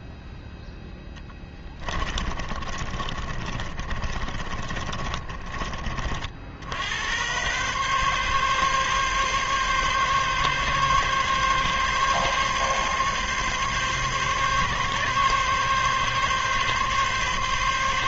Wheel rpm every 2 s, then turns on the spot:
0, 30, 30, 60, 140, 140, 140, 140, 140.
2-6